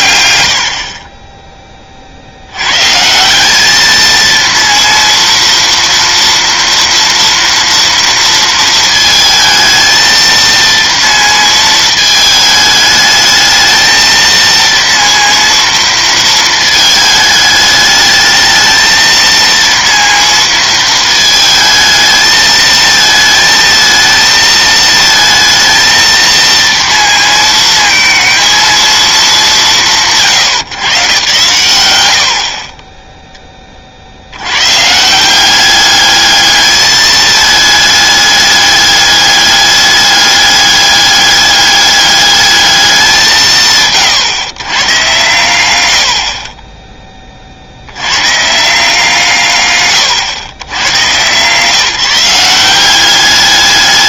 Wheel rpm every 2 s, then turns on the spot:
50, 130, 230, 230, 230, 230, 220, 230, 220, 220, 220, 220, 220, 230, 230, 120, 20, 120, 210, 210, 200, 210, 120, 20, 160, 110, 180.
46-48